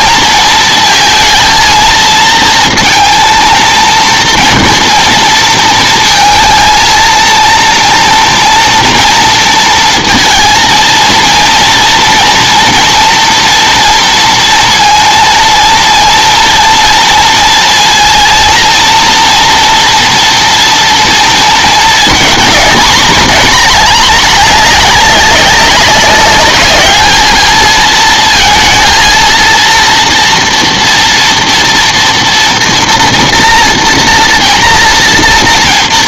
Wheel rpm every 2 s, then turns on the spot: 230, 230, 230, 230, 230, 230, 230, 230, 230, 230, 230, 230, 210, 210, 230, 230, 240, 230.
none